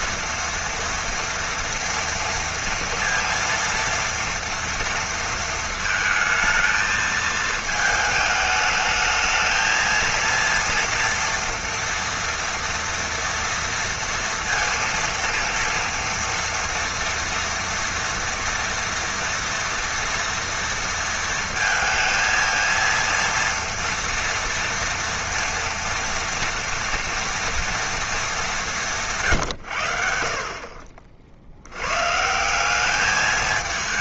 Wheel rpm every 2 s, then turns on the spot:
230, 230, 230, 230, 220, 230, 230, 230, 230, 230, 230, 230, 230, 230, 200, 50, 190.
none